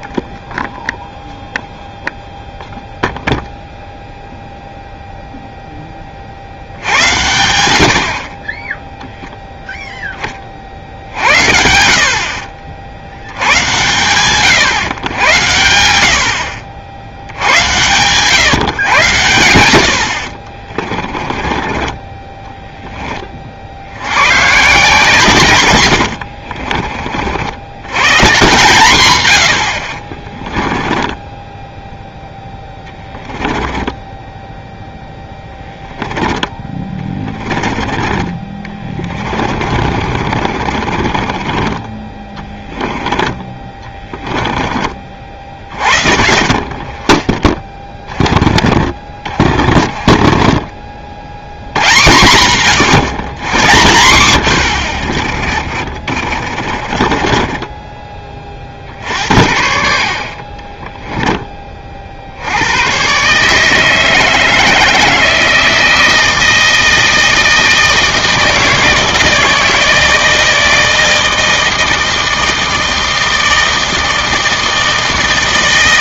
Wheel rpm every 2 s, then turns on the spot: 0, 0, 0, 70, 10, 50, 50, 120, 80, 130, 30, 10, 150, 40, 140, 20, 10, 0, 20, 20, 40, 20, 20, 50, 30, 40, 120, 80, 50, 50, 30, 80, 160, 160, 160, 160, 160, 160.
16-18 20-22 26-28 30-34 36-46 56-58